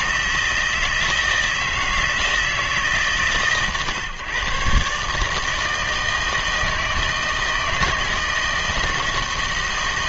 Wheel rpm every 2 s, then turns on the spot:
160, 140, 130, 160, 160.
none